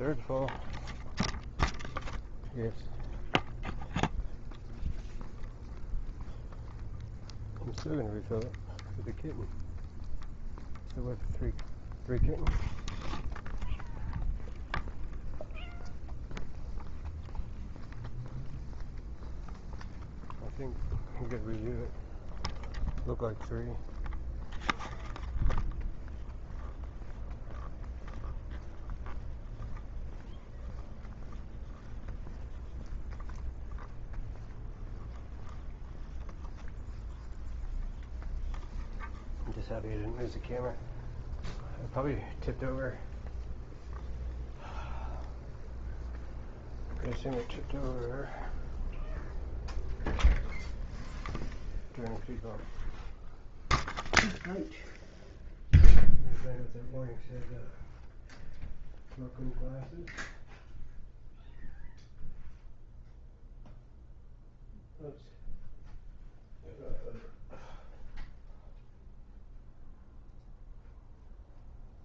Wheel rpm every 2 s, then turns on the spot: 0, 0, 0, 0, 0, 0, 0, 0, 0, 0, 0, 0, 0, 0, 0, 0, 0, 0, 0, 0, 0, 0, 0, 0, 0, 0, 0, 0, 0, 0, 0, 0, 0, 0, 0, 0.
none